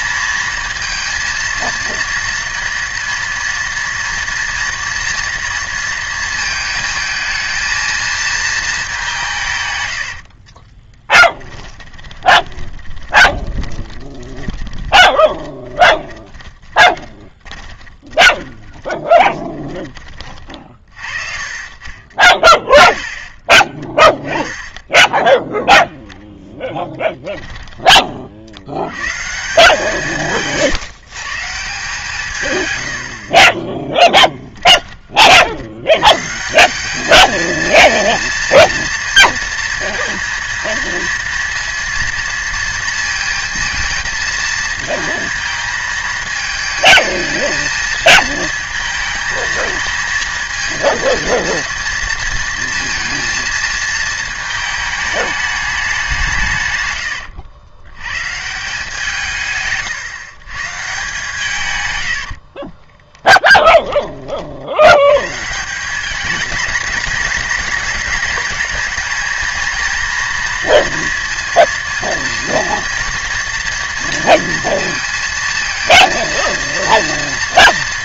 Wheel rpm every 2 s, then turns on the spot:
230, 230, 230, 220, 190, 20, 20, 20, 20, 20, 40, 20, 10, 10, 110, 140, 100, 30, 210, 230, 230, 230, 220, 220, 220, 220, 230, 220, 120, 170, 150, 20, 100, 210, 210, 230, 230, 230, 230.
10-28 56-58 62-64